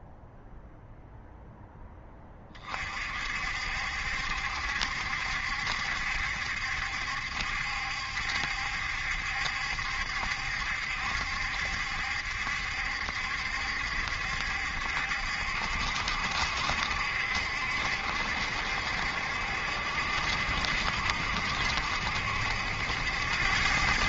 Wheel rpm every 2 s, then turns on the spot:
0, 40, 70, 70, 70, 70, 70, 70, 70, 70, 70, 80.
none